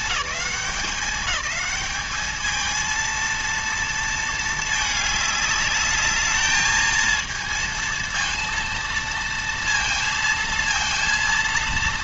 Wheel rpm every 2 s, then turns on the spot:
210, 220, 210, 220, 230, 230.
none